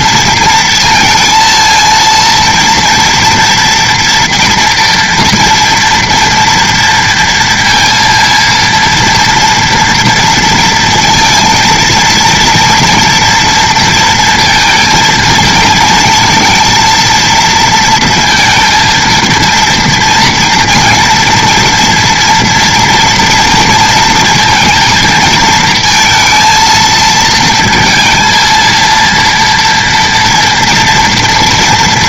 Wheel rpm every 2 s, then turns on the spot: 220, 230, 240, 230, 230, 230, 230, 230, 230, 230, 230, 240, 230, 230, 230, 230.
none